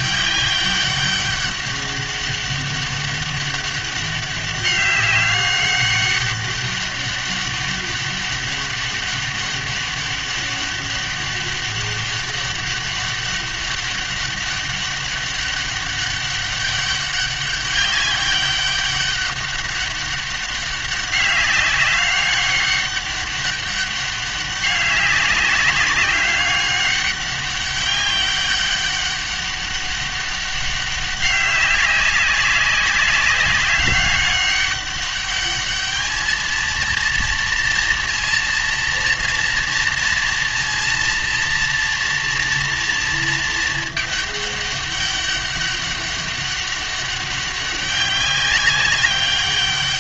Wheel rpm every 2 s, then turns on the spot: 200, 200, 200, 200, 200, 200, 200, 200, 200, 200, 200, 200, 200, 200, 200, 200, 200, 200, 230, 230, 230, 230, 200, 200, 190.
none